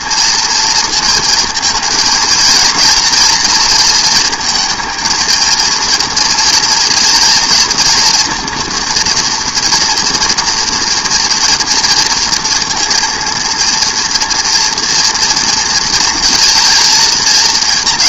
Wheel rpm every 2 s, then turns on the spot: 230, 220, 230, 230, 240, 230, 230, 240, 230.
none